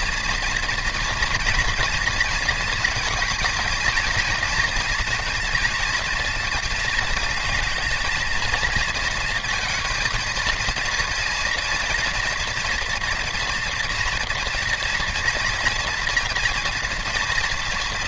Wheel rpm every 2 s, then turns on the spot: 230, 230, 230, 220, 230, 230, 230, 230, 230.
none